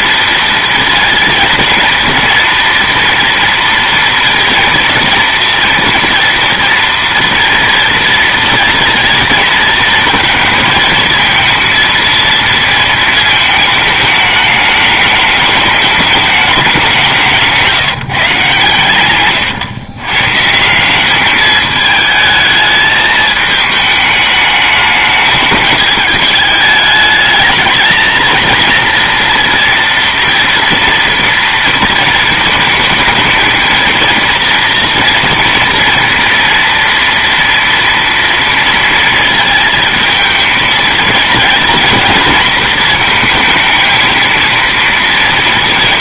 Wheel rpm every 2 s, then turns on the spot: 230, 230, 230, 230, 230, 220, 230, 210, 200, 140, 160, 220, 210, 210, 230, 230, 220, 230, 230, 230, 220, 230, 230.
none